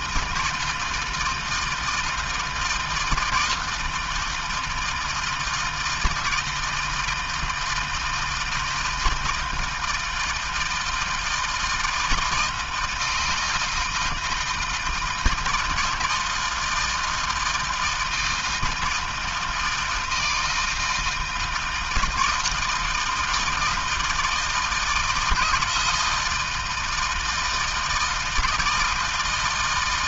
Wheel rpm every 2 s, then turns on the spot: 160, 160, 160, 160, 160, 160, 160, 160, 160, 160, 160, 170, 160, 160, 160.
none